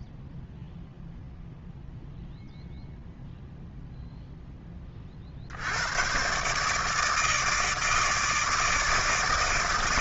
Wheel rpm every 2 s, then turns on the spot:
0, 0, 50, 160, 160.
none